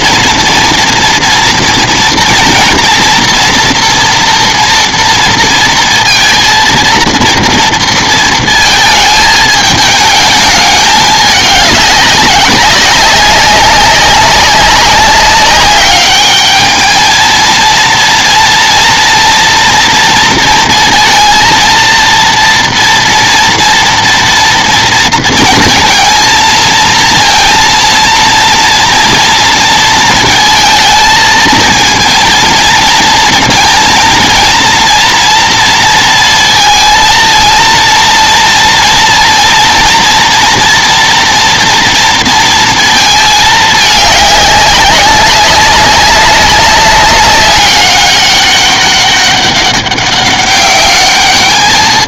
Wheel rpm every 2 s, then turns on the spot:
230, 230, 230, 230, 230, 220, 200, 200, 210, 230, 230, 230, 230, 220, 230, 230, 230, 230, 230, 230, 230, 230, 200, 200, 200, 200.
none